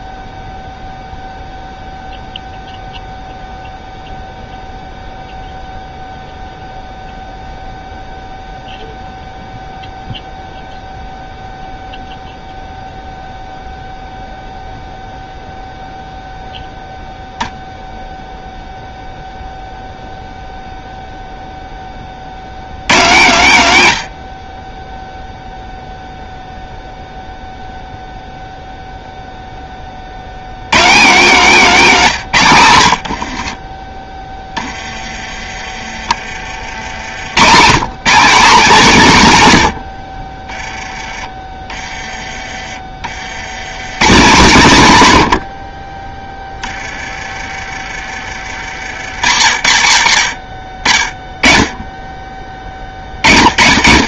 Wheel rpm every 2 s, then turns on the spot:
0, 0, 0, 0, 0, 0, 0, 0, 0, 0, 0, 110, 30, 0, 0, 130, 110, 20, 60, 210, 20, 30, 130, 20, 40, 20, 40.
46-48